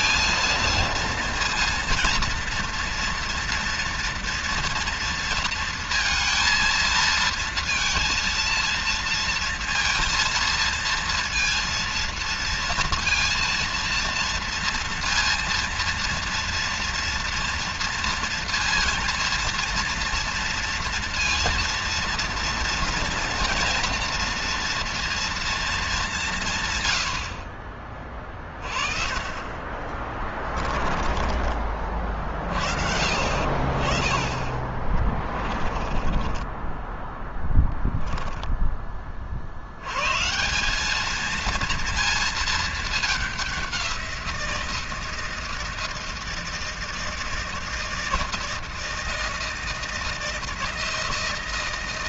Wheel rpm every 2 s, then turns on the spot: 230, 230, 230, 230, 230, 230, 230, 230, 230, 230, 230, 230, 240, 130, 30, 20, 50, 30, 10, 10, 190, 220, 170, 160, 160, 160.
26-28 30-32 34-40